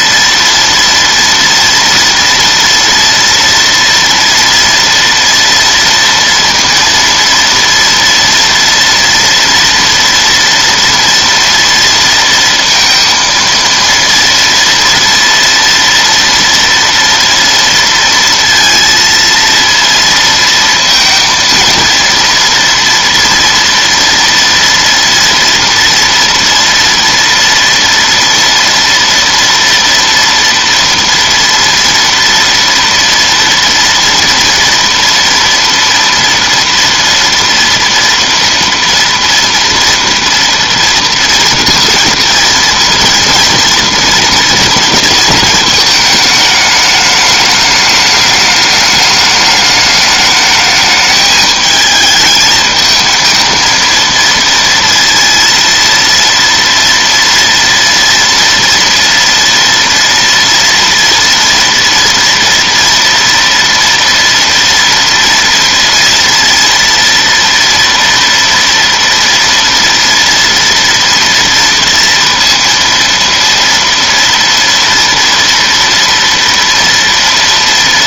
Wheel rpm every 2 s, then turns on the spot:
230, 230, 230, 230, 230, 230, 230, 230, 230, 230, 230, 230, 230, 240, 230, 230, 230, 230, 230, 230, 230, 230, 230, 210, 210, 210, 220, 230, 230, 230, 230, 230, 230, 230, 230, 230, 230, 230, 230.
none